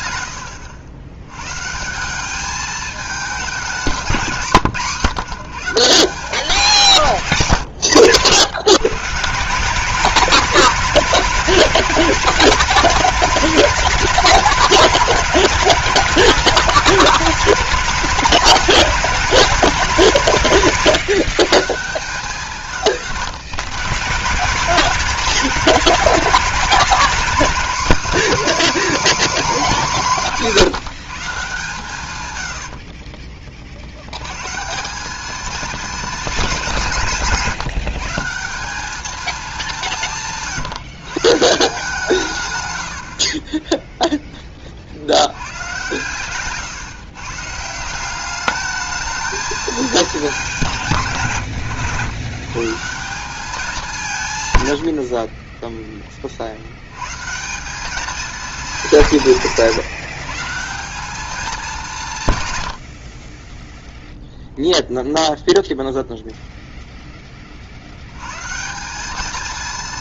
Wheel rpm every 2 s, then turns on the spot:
90, 210, 170, 180, 150, 200, 220, 220, 220, 220, 170, 160, 190, 220, 290, 180, 80, 160, 190, 190, 150, 110, 30, 130, 210, 180, 150, 110, 70, 200, 180, 100, 0, 0, 160.
none